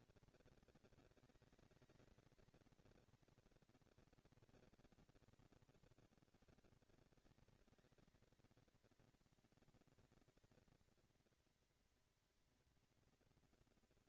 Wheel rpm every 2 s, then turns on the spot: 220, 230, 160, 160, 230, 230, 230.
none